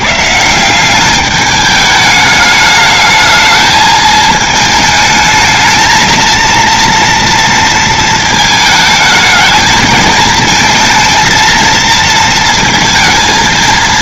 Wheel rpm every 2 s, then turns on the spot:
140, 210, 220, 230, 230, 220, 220.
none